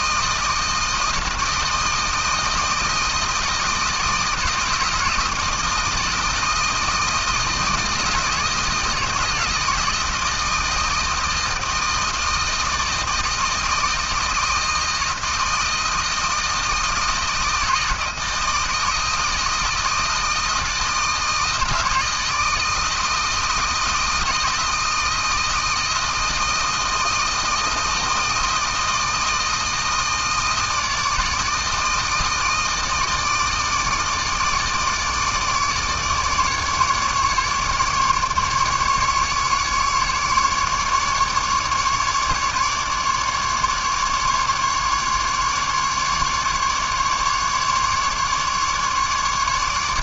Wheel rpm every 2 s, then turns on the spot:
160, 160, 160, 160, 160, 160, 160, 160, 160, 170, 160, 160, 160, 160, 160, 160, 160, 150, 150, 150, 150, 150, 150, 150, 150.
none